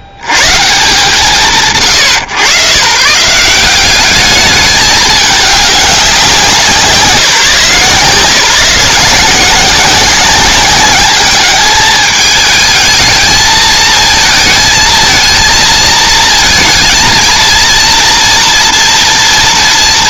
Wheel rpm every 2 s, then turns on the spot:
40, 120, 200, 180, 170, 180, 220, 220, 220, 240.
none